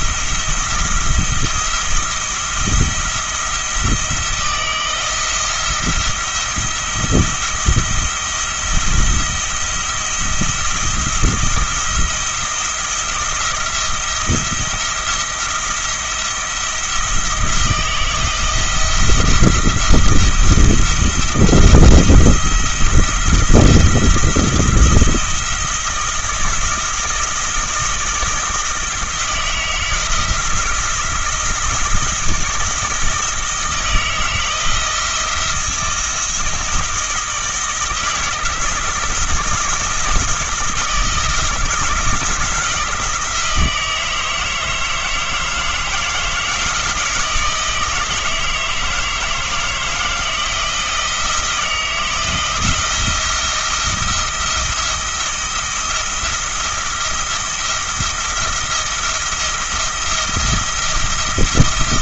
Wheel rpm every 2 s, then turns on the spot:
170, 170, 160, 170, 170, 170, 170, 170, 170, 170, 170, 170, 170, 160, 170, 170, 160, 160, 160, 160, 170, 160, 160, 160, 160, 160, 170, 170, 170, 170, 170.
none